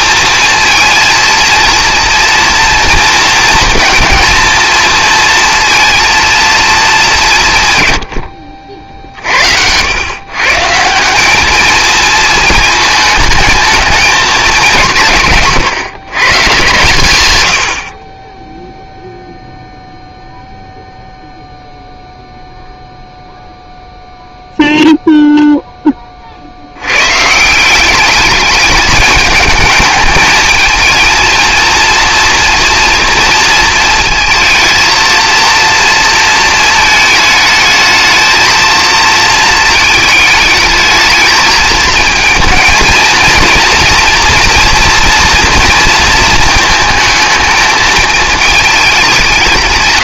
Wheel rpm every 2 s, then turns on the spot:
230, 230, 220, 220, 60, 160, 220, 190, 140, 0, 0, 0, 0, 80, 210, 220, 230, 230, 220, 230, 220, 220, 230, 220, 220.
none